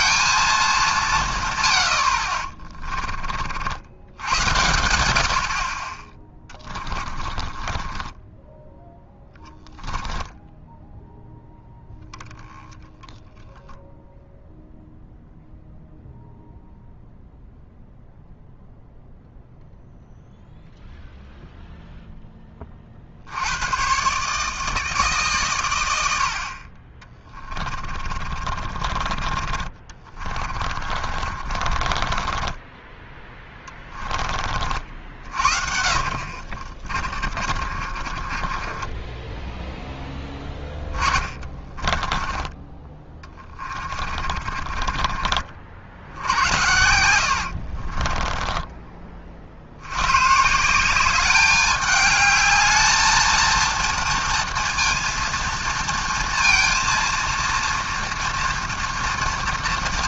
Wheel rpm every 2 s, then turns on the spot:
130, 40, 70, 20, 10, 0, 10, 0, 0, 0, 0, 70, 140, 30, 30, 40, 10, 50, 30, 10, 20, 30, 50, 80, 40, 190, 220, 230, 230, 230.
6-10 26-28 30-34 36-48